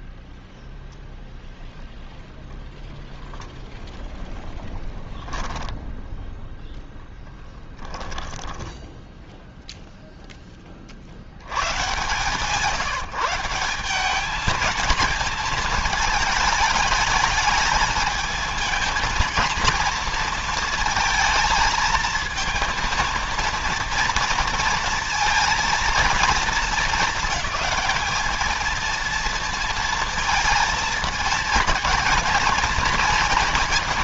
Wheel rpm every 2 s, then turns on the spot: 0, 0, 0, 0, 10, 40, 160, 220, 220, 220, 230, 230, 230, 220, 220, 230, 230.
8-10